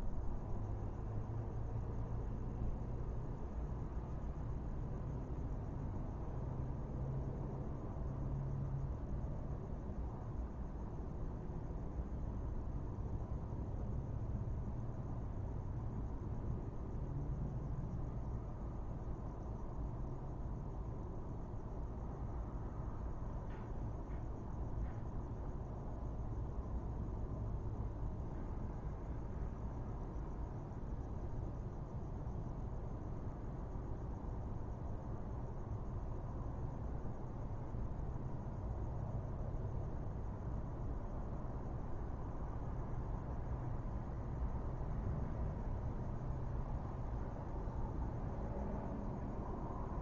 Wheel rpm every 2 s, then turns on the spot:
0, 0, 0, 0, 0, 0, 0, 0, 0, 0, 0, 0, 0, 0, 0, 0, 0, 0, 0, 0, 0, 0, 0, 0, 0.
none